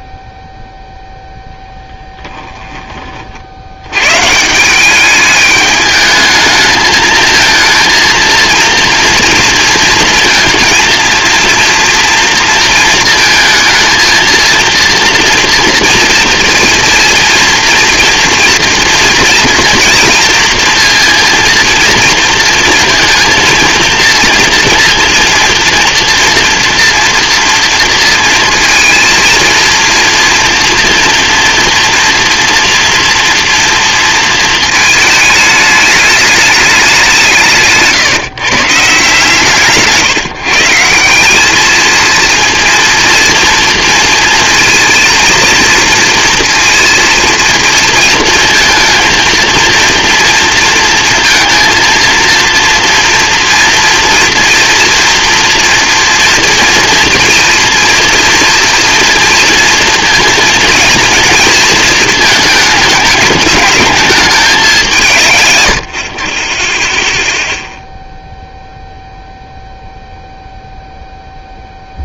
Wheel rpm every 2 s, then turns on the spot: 0, 20, 170, 220, 230, 230, 230, 230, 230, 230, 230, 230, 230, 240, 230, 230, 230, 230, 200, 160, 160, 230, 230, 230, 230, 230, 230, 230, 240, 240, 230, 210, 190, 20, 0, 0.
none